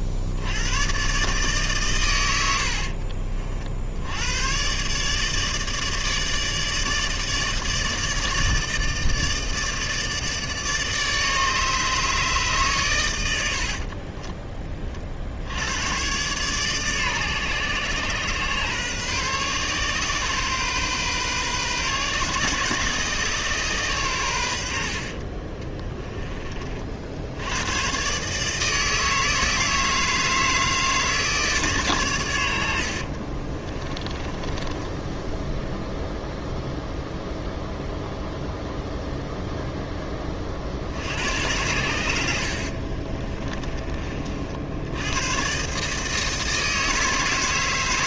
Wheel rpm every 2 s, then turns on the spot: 90, 90, 110, 150, 160, 160, 140, 20, 130, 130, 130, 130, 80, 30, 150, 160, 90, 20, 0, 0, 40, 70, 60, 160.
34-36 42-44